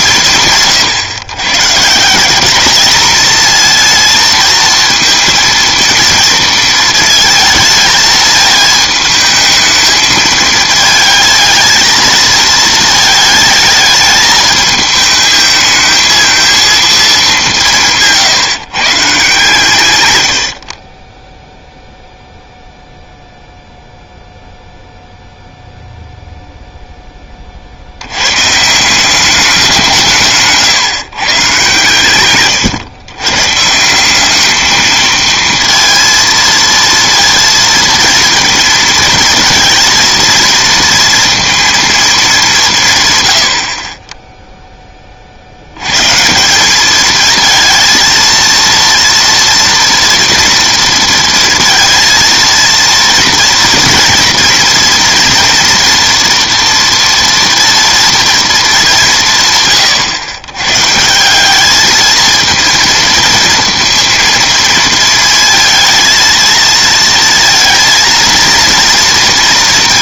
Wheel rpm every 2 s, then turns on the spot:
150, 200, 230, 220, 220, 220, 220, 210, 220, 140, 60, 0, 0, 0, 150, 140, 130, 220, 230, 230, 230, 190, 0, 180, 230, 230, 230, 230, 240, 220, 120, 230, 230, 230, 230.
none